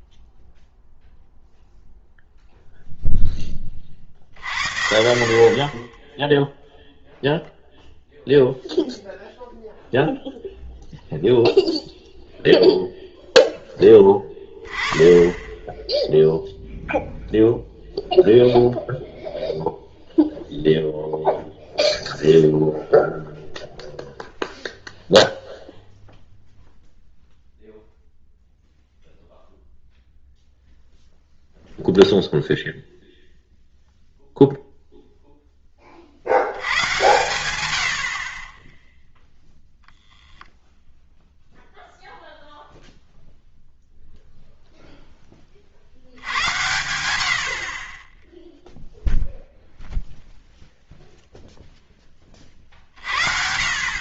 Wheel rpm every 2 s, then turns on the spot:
0, 0, 70, 0, 0, 0, 0, 10, 0, 0, 0, 0, 0, 0, 0, 0, 0, 0, 100, 10, 0, 0, 0, 100, 0, 0, 40.
none